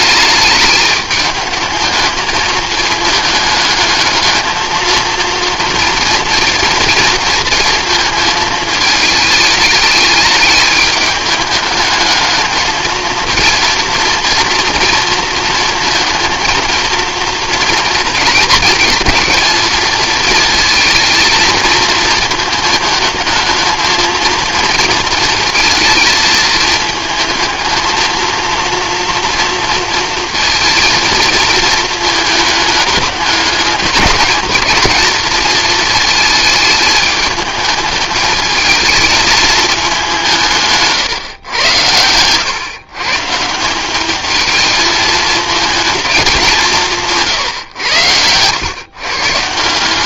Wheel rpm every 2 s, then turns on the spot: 210, 220, 220, 230, 220, 210, 220, 230, 230, 220, 220, 220, 230, 220, 230, 240, 210, 220, 220, 220, 150, 130, 220, 170, 110.
none